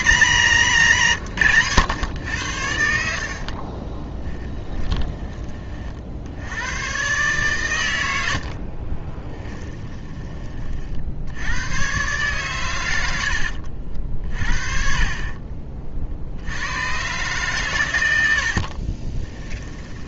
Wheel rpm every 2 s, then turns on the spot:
170, 70, 20, 110, 30, 40, 110, 30, 100, 40.
0-2 4-6 8-10 18-20